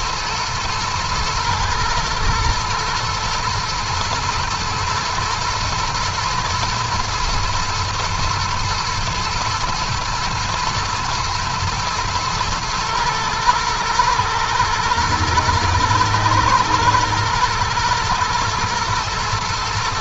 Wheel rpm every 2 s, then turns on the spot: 110, 110, 110, 120, 120, 120, 110, 110, 110, 110.
none